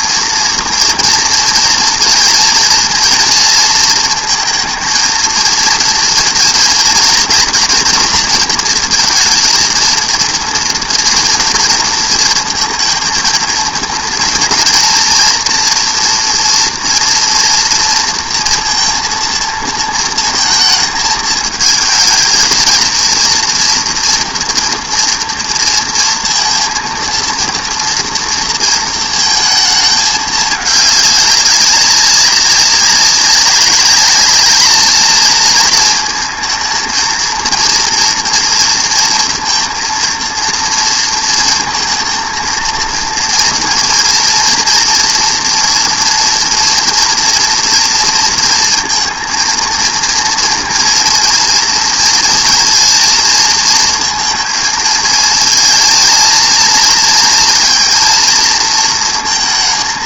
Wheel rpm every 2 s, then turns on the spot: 240, 230, 230, 230, 230, 230, 230, 240, 240, 230, 230, 230, 230, 230, 230, 210, 190, 210, 220, 230, 230, 230, 240, 230, 230, 230, 230, 230, 230, 230.
none